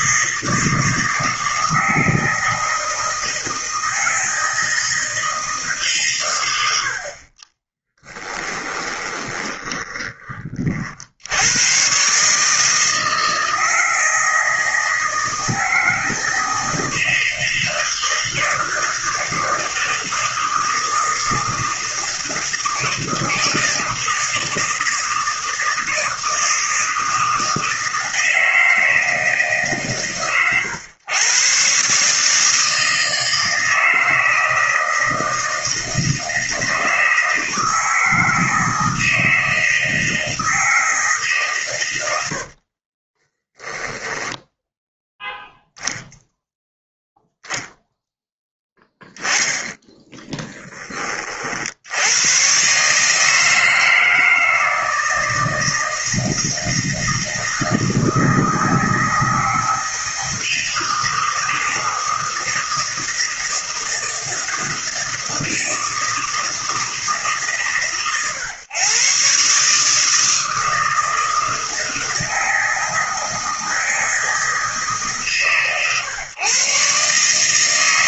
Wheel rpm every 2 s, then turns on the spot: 160, 160, 160, 100, 20, 40, 160, 160, 160, 160, 160, 160, 160, 160, 160, 110, 160, 160, 160, 160, 160, 50, 0, 0, 10, 30, 140, 160, 160, 160, 160, 160, 160, 160, 130, 160, 160, 150, 130.
8-10 42-44 50-52